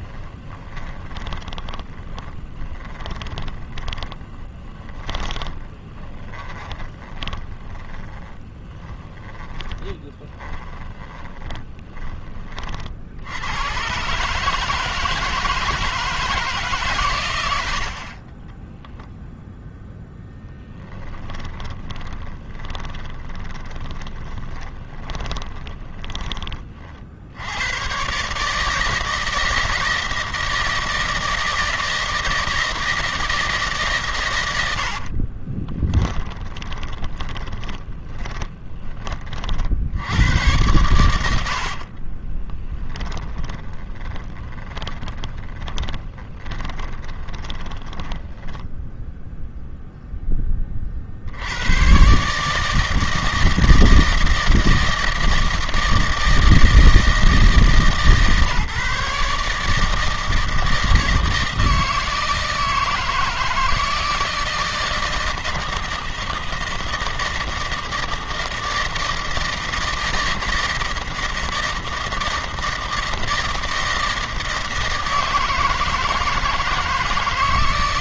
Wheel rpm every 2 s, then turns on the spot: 20, 20, 30, 20, 10, 20, 60, 160, 130, 0, 10, 20, 20, 50, 160, 160, 160, 60, 10, 20, 90, 10, 20, 20, 10, 50, 160, 160, 160, 150, 160, 160, 160, 160, 160, 160, 160, 160, 160.
0-12 20-26 34-38 40-48